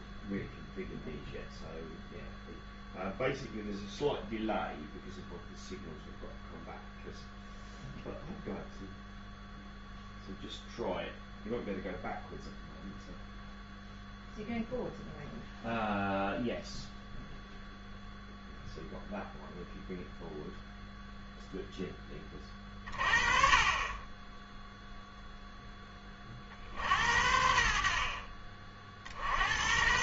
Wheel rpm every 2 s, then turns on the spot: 0, 0, 0, 0, 0, 0, 0, 0, 0, 0, 0, 30, 0, 60, 40.
none